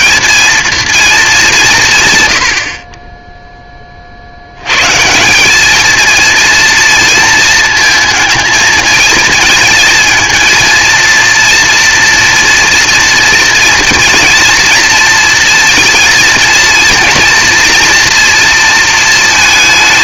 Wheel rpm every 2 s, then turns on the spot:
230, 70, 110, 240, 220, 230, 240, 230, 230, 230.
none